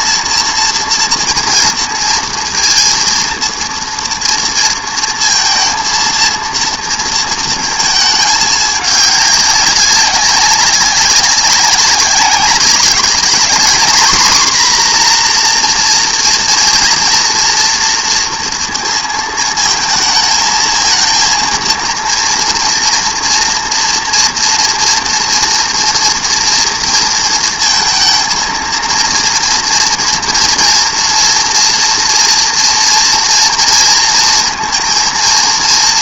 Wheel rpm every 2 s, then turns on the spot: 230, 230, 230, 230, 200, 190, 200, 250, 230, 230, 220, 230, 230, 230, 230, 230, 240, 230.
none